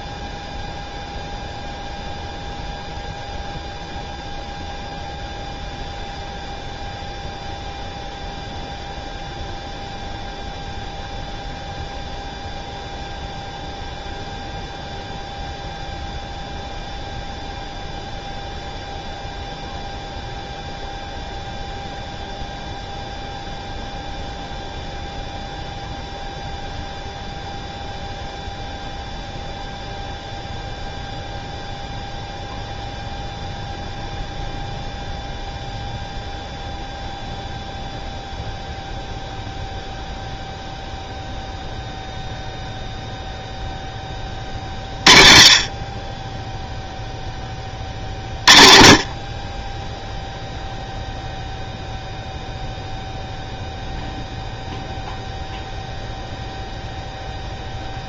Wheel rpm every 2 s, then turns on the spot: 0, 0, 0, 0, 0, 0, 0, 0, 0, 0, 0, 0, 0, 0, 0, 0, 0, 0, 0, 0, 0, 0, 30, 0, 50, 0, 0, 0, 0.
none